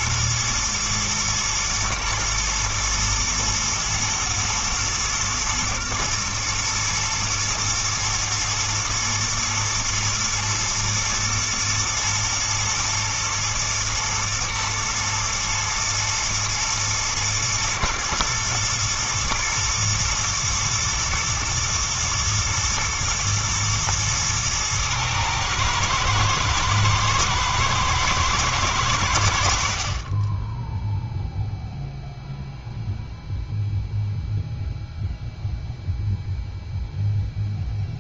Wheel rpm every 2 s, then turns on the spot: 110, 120, 110, 110, 120, 110, 110, 120, 110, 120, 120, 110, 110, 120, 100, 0, 0, 0, 0.
none